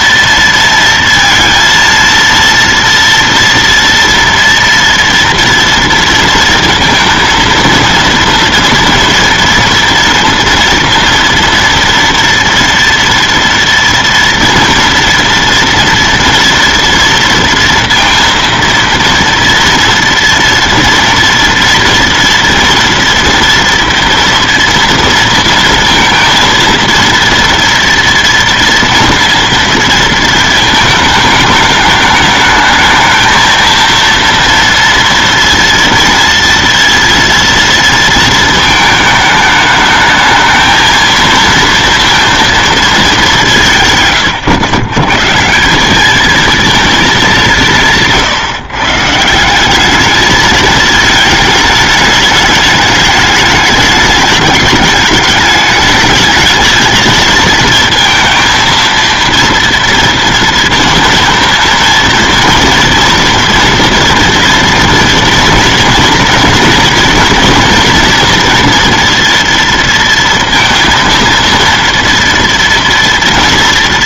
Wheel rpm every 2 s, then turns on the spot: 230, 230, 230, 230, 230, 230, 230, 230, 230, 230, 230, 230, 230, 230, 230, 230, 220, 230, 230, 220, 220, 230, 110, 220, 150, 210, 210, 210, 220, 230, 230, 230, 230, 230, 230, 230, 230.
none